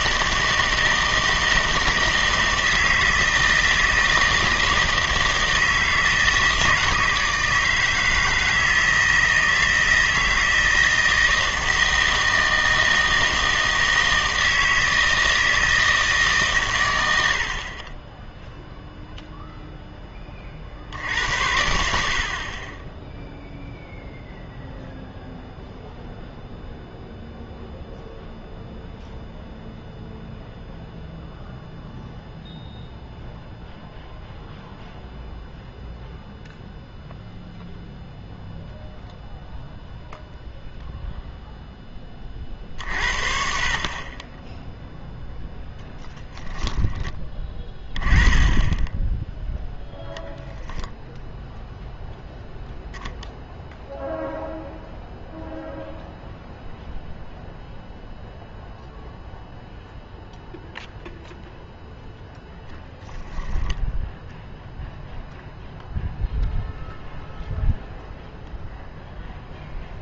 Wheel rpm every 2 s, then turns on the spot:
160, 160, 160, 160, 160, 160, 160, 160, 120, 0, 50, 20, 0, 0, 0, 0, 0, 0, 0, 0, 0, 50, 0, 10, 10, 0, 0, 0, 0, 0, 0, 0, 0, 0, 0.
46-48